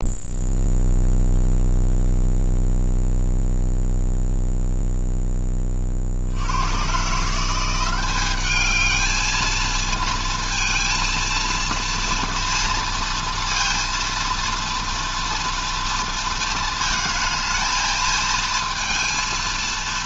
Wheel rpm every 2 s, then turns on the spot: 0, 0, 0, 110, 220, 230, 230, 230, 220, 230.
none